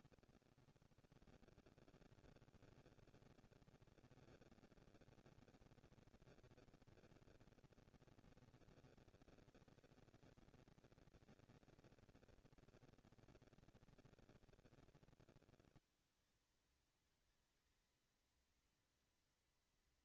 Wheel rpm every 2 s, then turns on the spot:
120, 150, 230, 230, 230, 230, 230, 190, 180, 230.
none